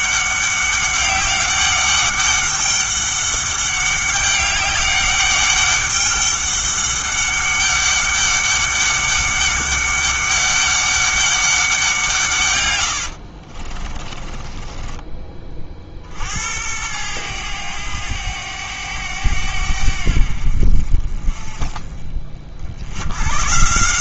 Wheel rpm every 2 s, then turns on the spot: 190, 200, 200, 200, 200, 200, 110, 20, 90, 100, 50, 60.
12-16